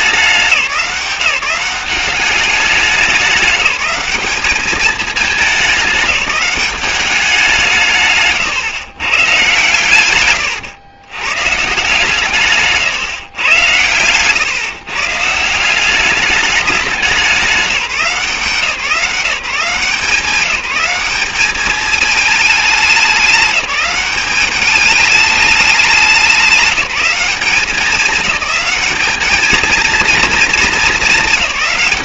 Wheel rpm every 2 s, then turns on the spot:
180, 190, 210, 200, 130, 110, 150, 140, 210, 170, 190, 210, 200, 200, 210, 220.
none